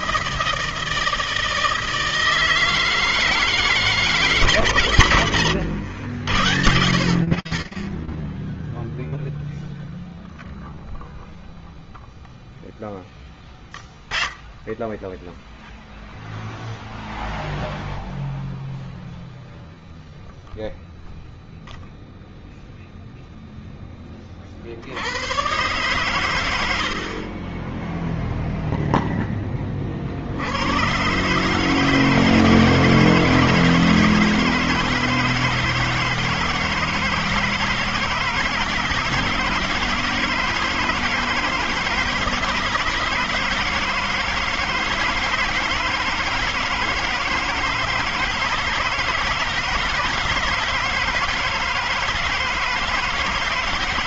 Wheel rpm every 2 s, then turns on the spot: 160, 160, 150, 110, 10, 0, 10, 10, 0, 0, 0, 0, 80, 70, 0, 120, 160, 160, 160, 160, 160, 160, 160, 160, 160, 160, 160.
none